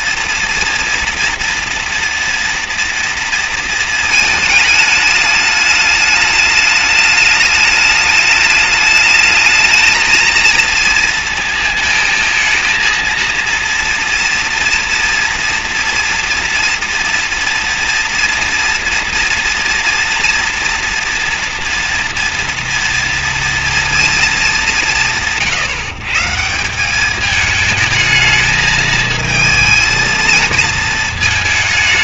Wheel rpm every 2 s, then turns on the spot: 230, 230, 220, 210, 210, 230, 230, 240, 230, 230, 230, 230, 200, 170, 220, 230.
none